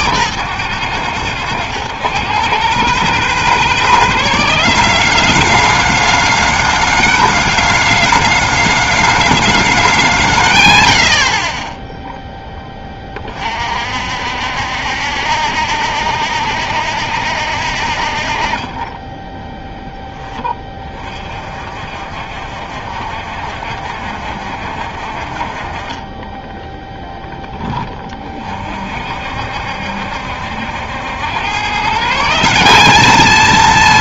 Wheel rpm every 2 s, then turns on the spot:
130, 140, 190, 210, 210, 130, 10, 60, 70, 30, 30, 60, 60, 10, 40, 70, 190.
none